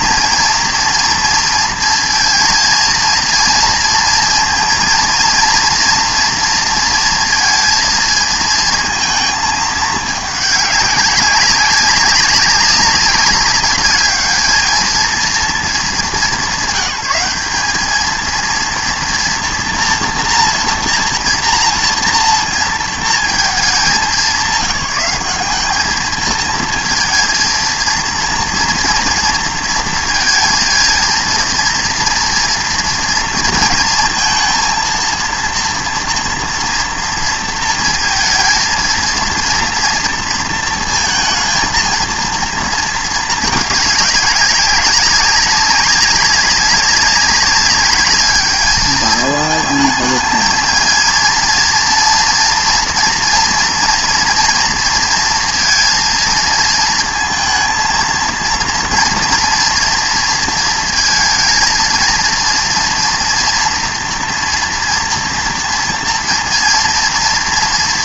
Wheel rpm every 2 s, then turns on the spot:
230, 230, 230, 230, 230, 200, 200, 220, 190, 230, 230, 230, 190, 230, 230, 230, 230, 230, 230, 230, 230, 230, 190, 190, 210, 230, 230, 240, 230, 230, 230, 240, 230, 230.
none